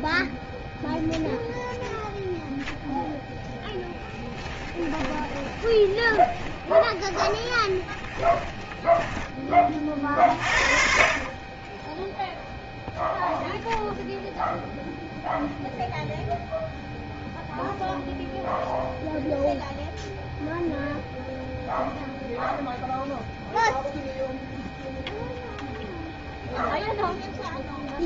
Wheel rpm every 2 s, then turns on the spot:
0, 0, 10, 20, 10, 40, 0, 0, 0, 0, 0, 0, 0, 0.
4-10